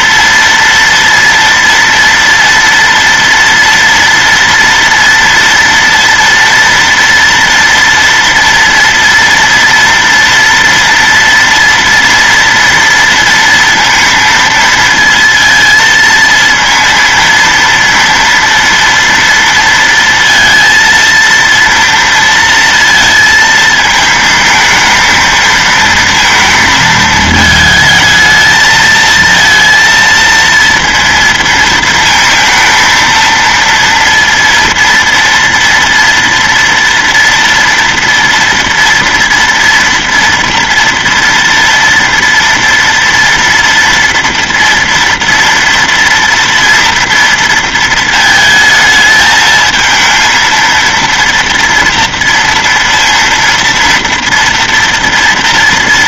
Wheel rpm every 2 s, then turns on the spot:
230, 230, 240, 230, 230, 230, 230, 230, 230, 230, 230, 230, 220, 230, 220, 230, 230, 230, 230, 230, 230, 230, 230, 230, 220, 220, 230, 230.
none